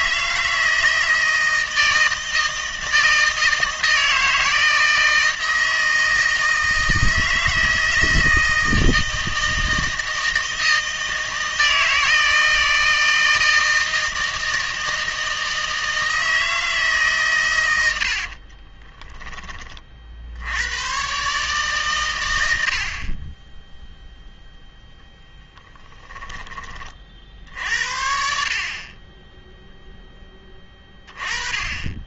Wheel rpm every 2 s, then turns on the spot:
160, 160, 160, 160, 160, 160, 160, 160, 150, 20, 100, 60, 0, 30, 40, 20.
18-20